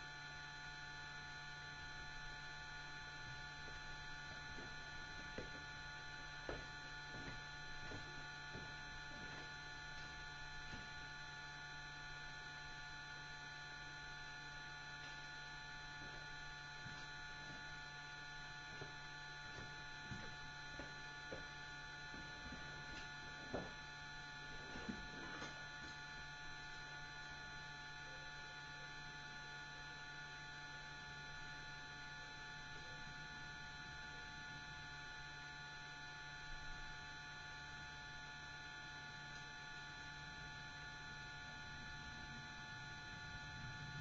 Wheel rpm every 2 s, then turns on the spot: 0, 0, 0, 0, 0, 0, 0, 0, 0, 0, 0, 0, 0, 0, 0, 0, 0, 0, 0, 0, 0, 0.
none